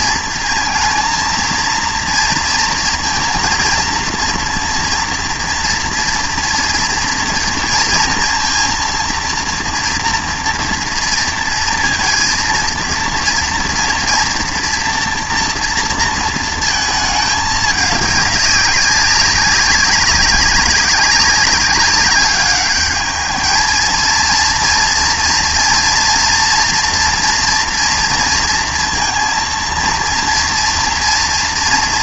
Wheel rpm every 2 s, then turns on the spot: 230, 230, 230, 230, 230, 230, 230, 230, 220, 200, 190, 210, 230, 240, 230, 240.
none